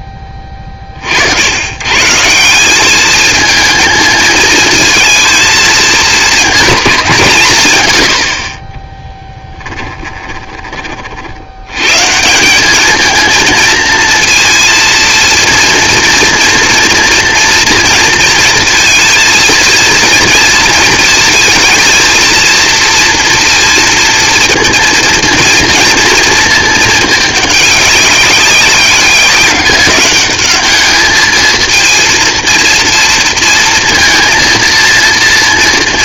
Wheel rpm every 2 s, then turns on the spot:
30, 190, 220, 220, 40, 30, 200, 230, 230, 220, 230, 230, 230, 220, 200, 210, 230, 230.
8-10